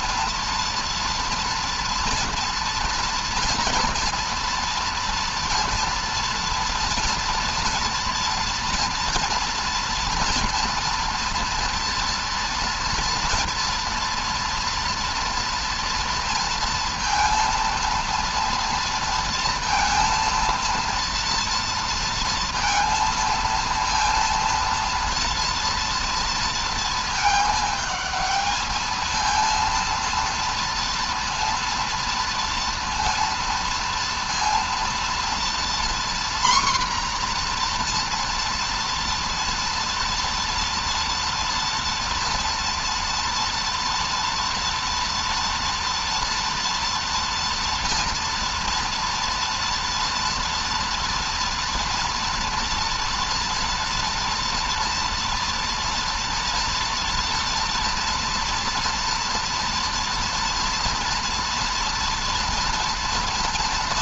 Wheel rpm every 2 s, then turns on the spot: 230, 230, 230, 240, 230, 230, 230, 230, 230, 230, 230, 230, 230, 230, 220, 230, 230, 230, 250, 230, 230, 230, 230, 240, 230, 230, 230, 230, 230, 230, 240, 230.
none